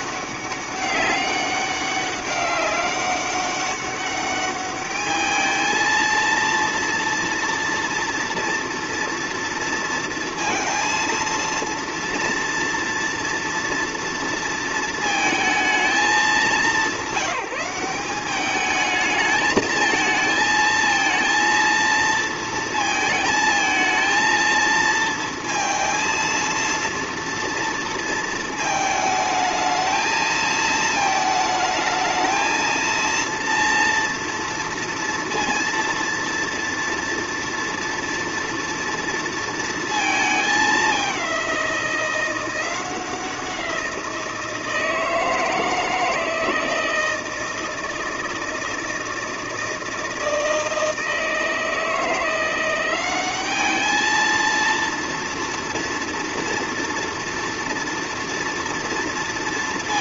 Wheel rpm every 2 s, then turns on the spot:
200, 200, 210, 230, 230, 230, 230, 230, 200, 210, 220, 230, 230, 230, 220, 220, 230, 230, 230, 230, 210, 180, 170, 160, 160, 160, 180, 230, 230, 230.
none